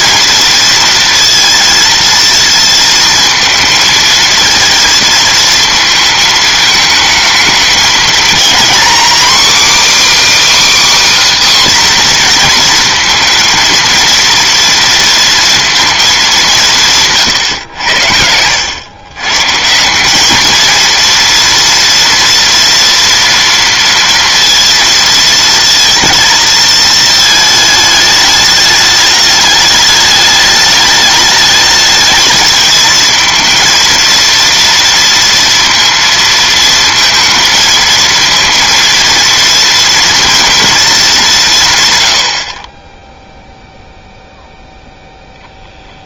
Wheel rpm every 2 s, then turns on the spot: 230, 230, 230, 220, 240, 310, 240, 230, 190, 100, 220, 230, 230, 220, 210, 210, 220, 230, 230, 230, 230, 40, 0.
none